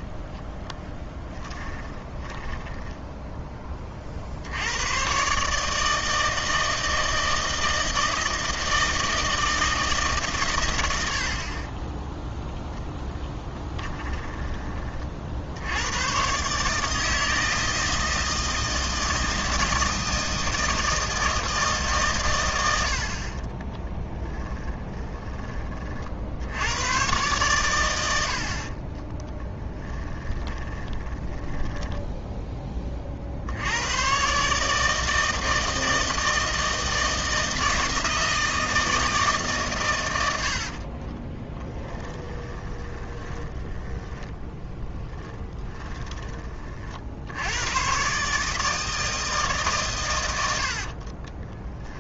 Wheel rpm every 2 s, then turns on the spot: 10, 10, 110, 160, 160, 100, 10, 30, 150, 160, 160, 80, 20, 100, 50, 20, 20, 150, 160, 160, 50, 20, 10, 50, 160, 60.
0-4 24-26 28-32 40-46 50-52